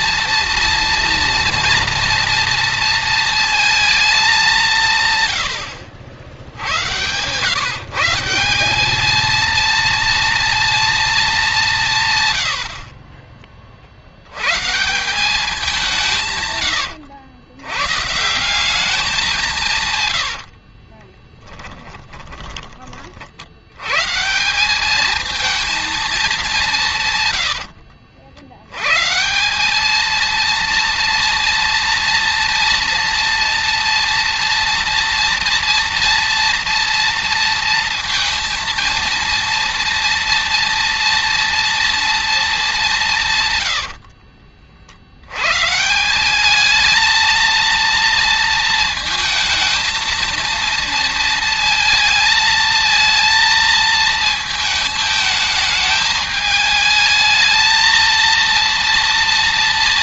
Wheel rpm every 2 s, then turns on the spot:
230, 230, 180, 90, 200, 230, 80, 150, 130, 190, 70, 30, 180, 190, 110, 230, 230, 230, 230, 230, 230, 200, 60, 210, 230, 230, 220, 220, 220, 230.
20-22